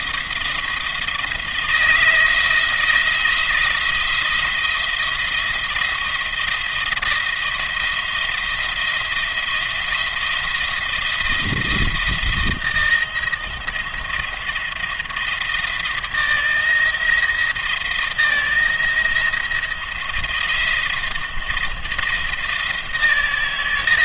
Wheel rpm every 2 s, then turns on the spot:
170, 170, 170, 170, 170, 170, 160, 160, 170, 160, 160, 160.
none